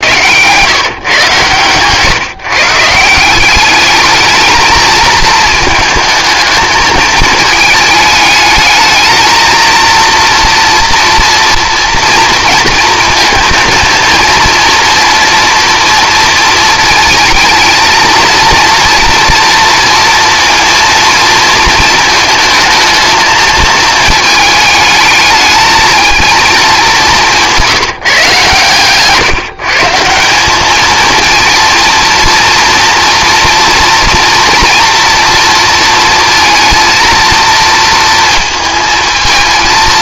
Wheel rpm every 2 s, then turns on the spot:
150, 160, 220, 220, 210, 230, 230, 230, 230, 230, 230, 220, 220, 210, 140, 210, 230, 230, 230, 220.
none